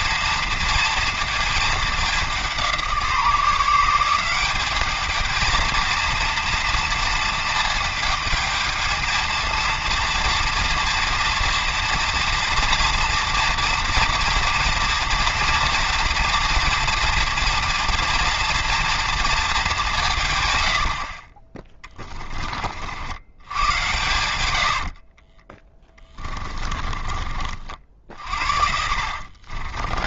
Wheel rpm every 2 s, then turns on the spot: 230, 170, 210, 230, 220, 230, 230, 230, 230, 230, 90, 60, 50, 30, 70.
24-30